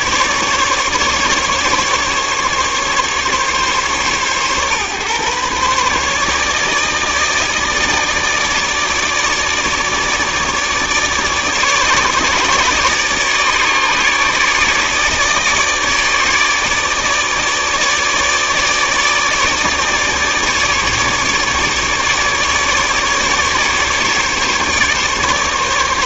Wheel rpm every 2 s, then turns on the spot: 150, 140, 130, 150, 150, 150, 150, 150, 150, 150, 150, 150, 150.
none